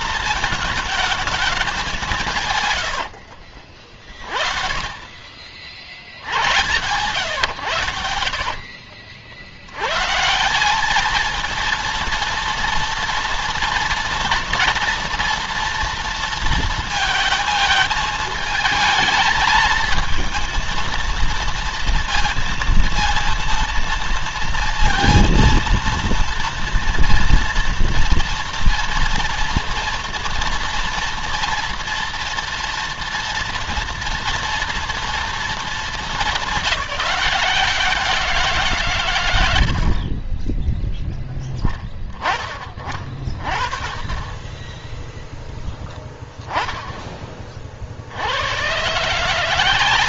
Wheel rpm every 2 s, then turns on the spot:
220, 90, 40, 110, 60, 200, 230, 240, 220, 220, 230, 230, 230, 230, 240, 230, 240, 230, 200, 130, 10, 30, 20, 20, 120.
2-4